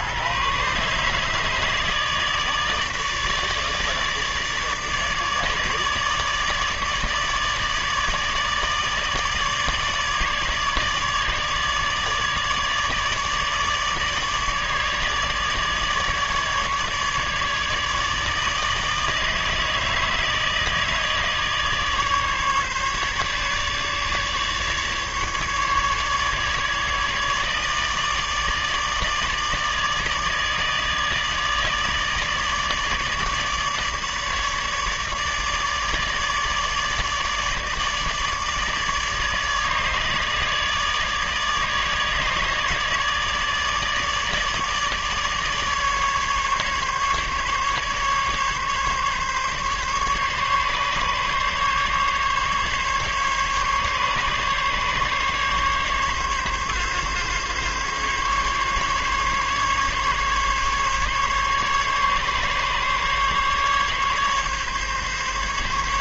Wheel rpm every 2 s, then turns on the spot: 140, 150, 150, 150, 150, 150, 150, 150, 150, 160, 160, 150, 150, 150, 150, 150, 160, 150, 150, 150, 150, 150, 150, 140, 140, 140, 140, 140, 140, 140, 140, 140, 140.
none